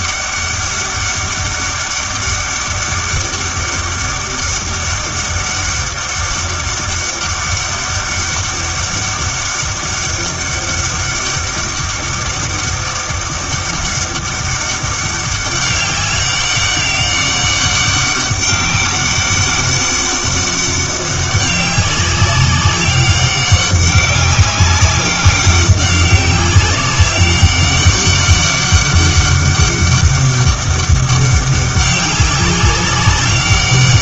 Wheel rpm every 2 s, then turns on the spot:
200, 200, 200, 200, 200, 200, 200, 200, 200, 200, 200, 200, 200, 200, 200, 200, 190.
none